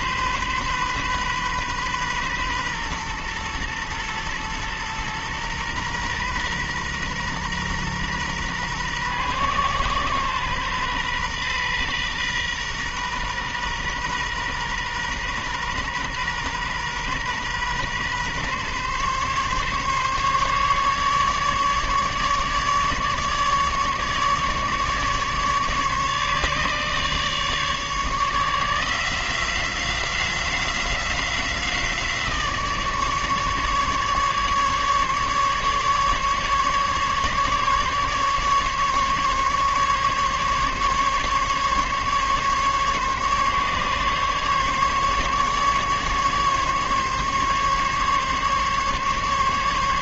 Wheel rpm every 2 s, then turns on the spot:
130, 120, 120, 120, 120, 120, 120, 120, 120, 130, 140, 150, 150, 150, 170, 180, 150, 150, 150, 140, 140, 140, 140, 140, 140.
none